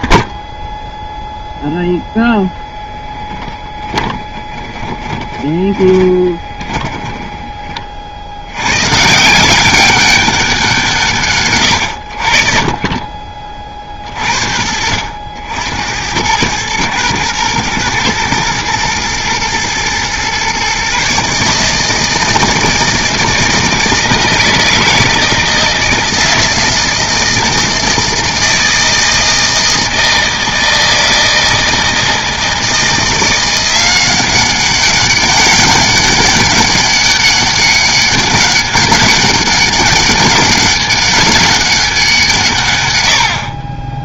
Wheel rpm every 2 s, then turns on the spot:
0, 0, 20, 20, 90, 190, 60, 60, 100, 120, 130, 160, 160, 160, 160, 160, 160, 190, 200, 200, 200, 150.
4-8